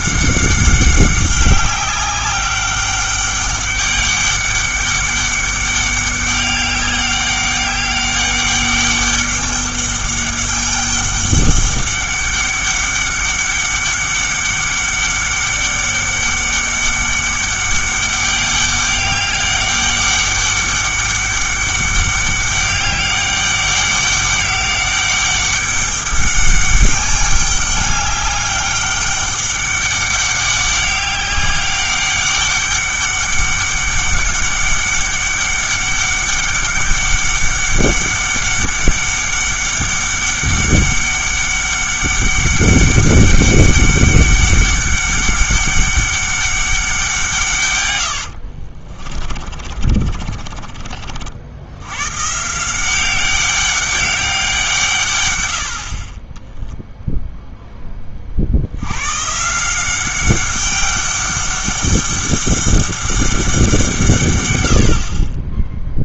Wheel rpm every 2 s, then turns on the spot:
190, 200, 200, 200, 200, 200, 200, 200, 200, 200, 200, 200, 200, 200, 200, 200, 200, 200, 200, 200, 200, 200, 200, 190, 50, 40, 160, 160, 0, 80, 200, 200, 80.
48-52